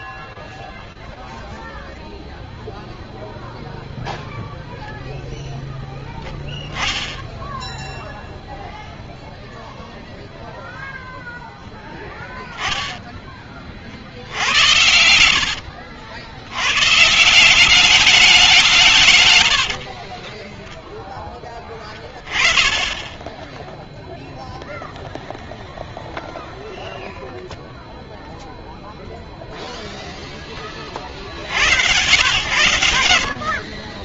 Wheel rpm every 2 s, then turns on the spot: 0, 0, 0, 10, 0, 0, 10, 80, 150, 110, 10, 10, 0, 0, 0, 110, 30.
none